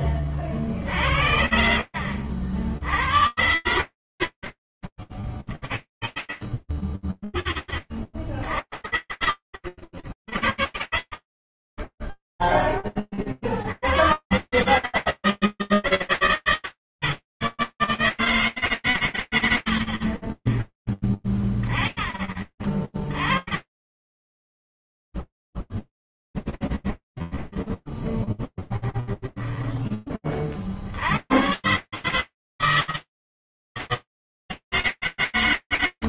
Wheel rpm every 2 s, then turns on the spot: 50, 70, 50, 20, 60, 40, 0, 120, 150, 80, 30, 40, 10, 10, 10, 90, 160, 130.
6-8 26-30